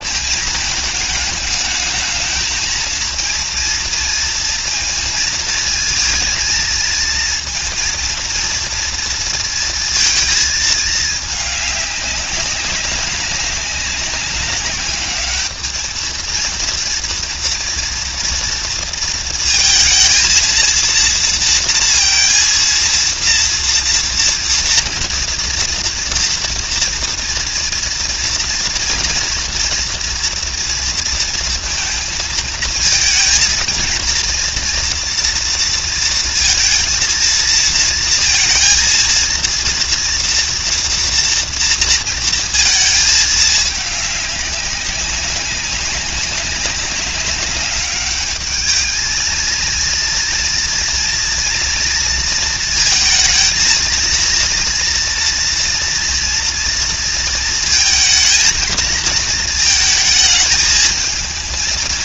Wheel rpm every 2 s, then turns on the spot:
220, 220, 230, 230, 230, 220, 200, 200, 230, 230, 230, 230, 230, 230, 230, 230, 220, 240, 230, 230, 230, 220, 200, 190, 210, 230, 230, 230, 230, 230, 220.
none